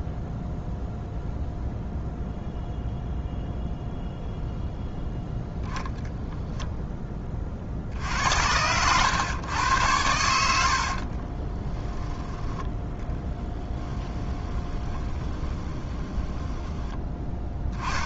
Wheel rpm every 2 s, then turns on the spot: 0, 0, 0, 0, 90, 70, 10, 20, 10.
10-12 14-18